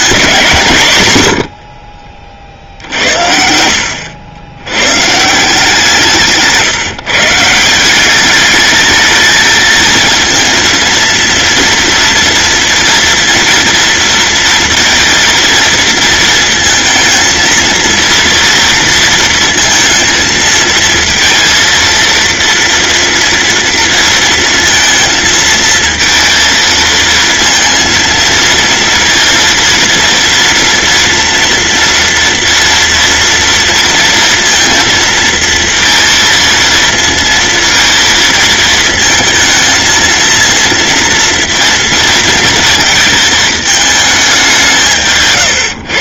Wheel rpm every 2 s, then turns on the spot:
130, 70, 110, 160, 210, 230, 230, 230, 230, 230, 230, 230, 230, 230, 230, 230, 230, 230, 230, 220, 230, 220, 160.
none